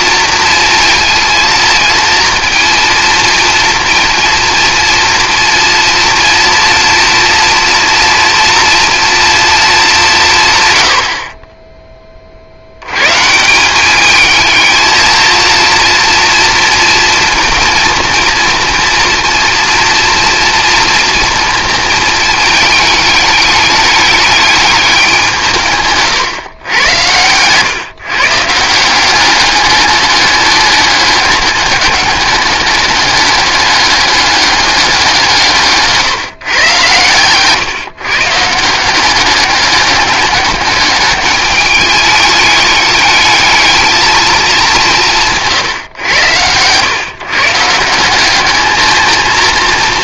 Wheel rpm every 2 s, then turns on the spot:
230, 230, 230, 240, 240, 90, 100, 220, 230, 230, 230, 220, 200, 110, 170, 200, 200, 200, 130, 170, 200, 210, 190, 120, 220.
none